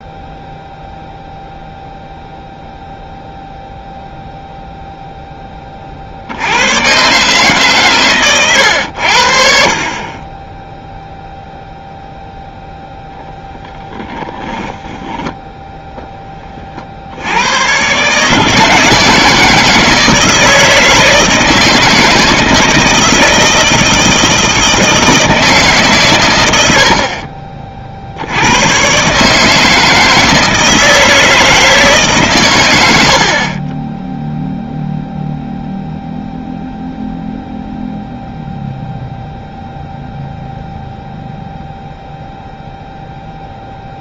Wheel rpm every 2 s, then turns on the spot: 0, 0, 0, 100, 110, 0, 0, 20, 40, 160, 160, 160, 160, 80, 100, 160, 100, 0, 0, 0, 0, 0.
14-16